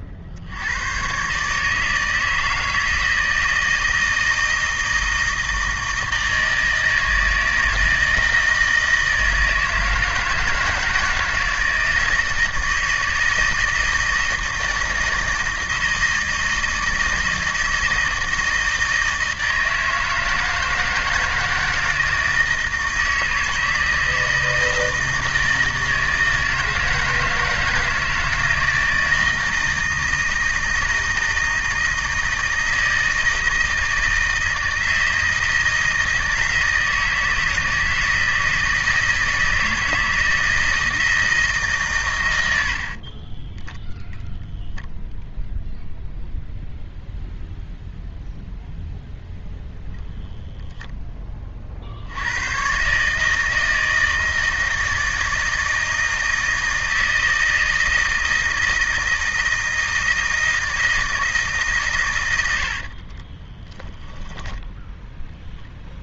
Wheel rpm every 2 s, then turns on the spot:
50, 160, 160, 160, 160, 160, 160, 160, 160, 160, 160, 160, 160, 160, 160, 160, 160, 160, 160, 160, 160, 40, 0, 0, 0, 10, 140, 160, 160, 160, 160, 50, 0.
42-44 62-64